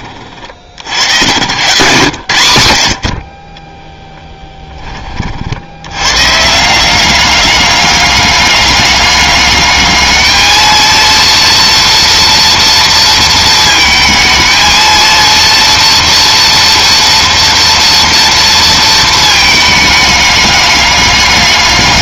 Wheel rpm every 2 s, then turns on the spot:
60, 100, 10, 170, 200, 230, 230, 220, 230, 230, 200.
none